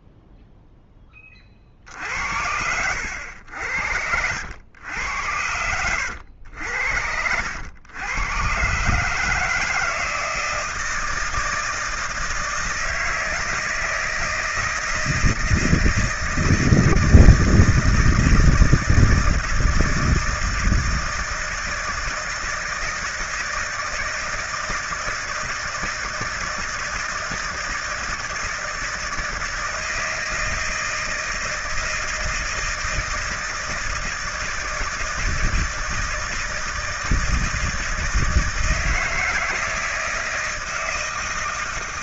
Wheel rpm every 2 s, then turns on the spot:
0, 80, 90, 90, 120, 160, 170, 160, 160, 160, 160, 160, 160, 160, 160, 160, 160, 160, 160, 160, 160.
2-4